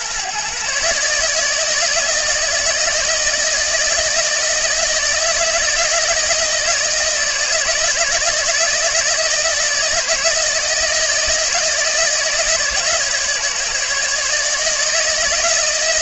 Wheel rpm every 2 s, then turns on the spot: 150, 160, 160, 160, 160, 160, 150, 160.
none